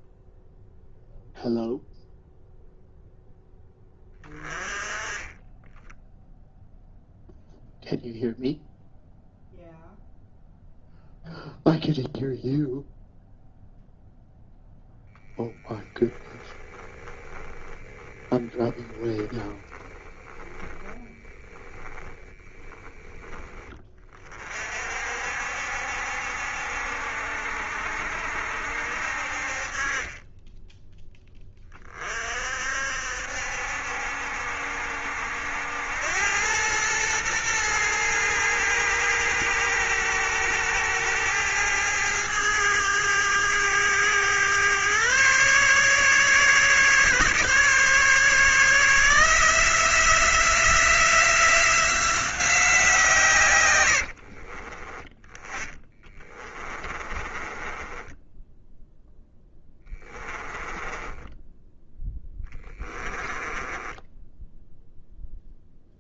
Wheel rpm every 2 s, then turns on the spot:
0, 0, 20, 0, 0, 0, 0, 0, 10, 10, 10, 20, 50, 70, 60, 10, 60, 70, 110, 110, 110, 110, 120, 140, 160, 180, 160, 20, 30, 0, 20, 20, 0.
16-24 54-58 60-64